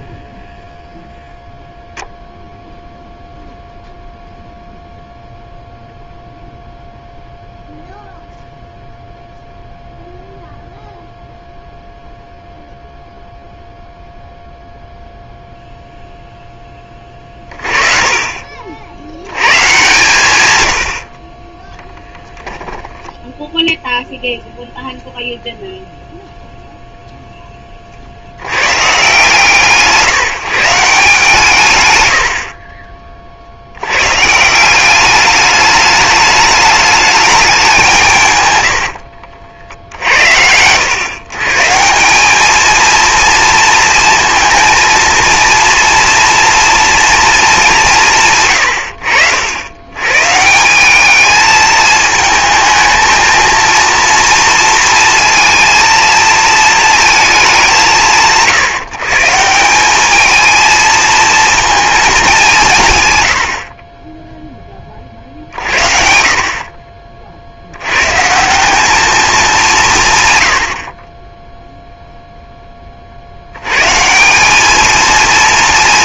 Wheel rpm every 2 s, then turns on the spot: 0, 0, 0, 0, 0, 0, 0, 0, 30, 130, 0, 0, 0, 40, 140, 90, 90, 210, 170, 60, 160, 230, 230, 190, 90, 220, 230, 230, 180, 190, 230, 50, 50, 100, 190, 0, 90, 230.
none